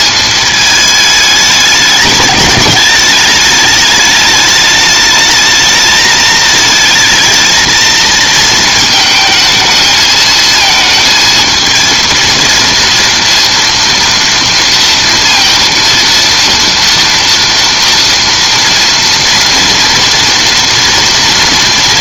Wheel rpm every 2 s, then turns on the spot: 220, 210, 210, 220, 220, 220, 230, 230, 230, 230, 230.
none